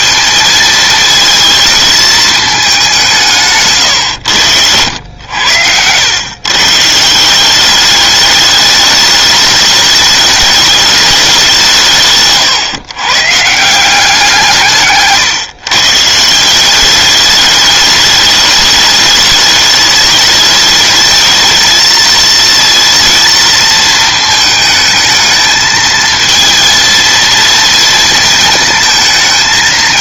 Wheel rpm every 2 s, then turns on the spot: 230, 190, 90, 150, 210, 210, 130, 140, 200, 210, 220, 230, 220, 230, 220.
4-6 14-16